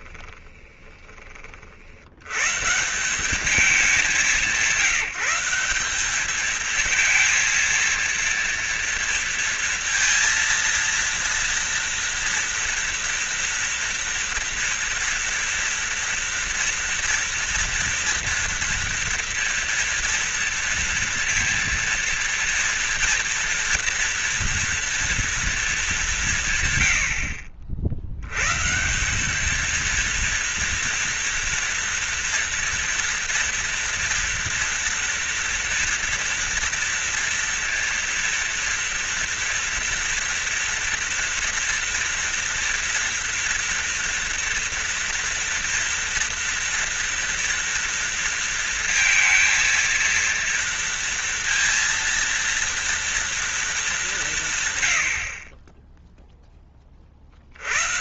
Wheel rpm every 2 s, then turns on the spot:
20, 160, 190, 220, 230, 230, 230, 230, 230, 230, 230, 240, 240, 100, 160, 230, 230, 230, 230, 230, 230, 230, 230, 240, 230, 230, 230, 120, 30.
0-2